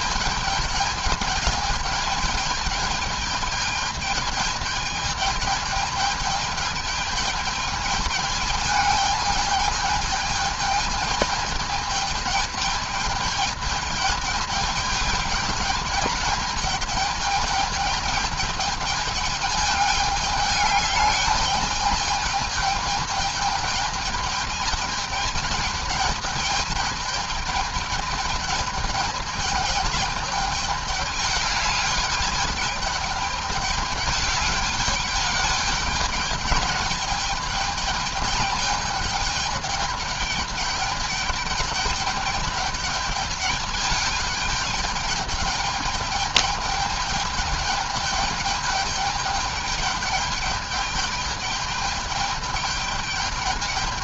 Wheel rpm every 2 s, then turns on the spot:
210, 210, 210, 210, 210, 210, 210, 210, 220, 210, 210, 210, 210, 210, 210, 210, 210, 210, 210, 210, 210, 210, 210, 210, 210, 210, 210.
none